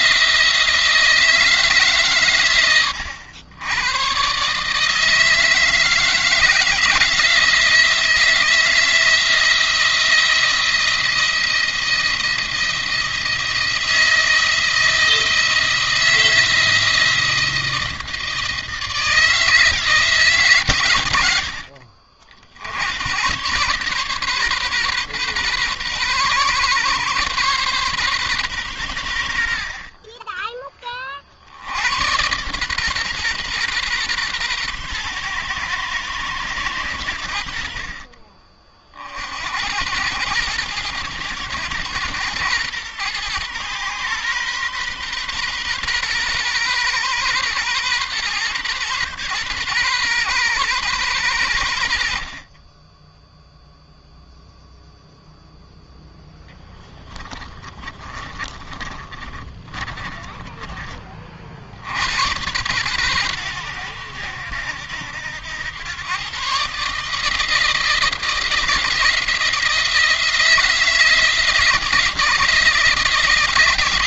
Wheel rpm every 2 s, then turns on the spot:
170, 100, 140, 160, 170, 170, 170, 160, 170, 160, 120, 80, 140, 130, 110, 30, 130, 120, 100, 40, 110, 120, 130, 120, 120, 120, 30, 0, 10, 30, 30, 100, 80, 140, 170, 160, 160.
56-60